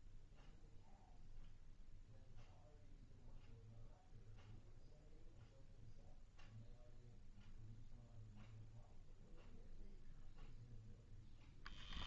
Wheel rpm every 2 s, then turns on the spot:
0, 0, 0, 0, 0, 0.
none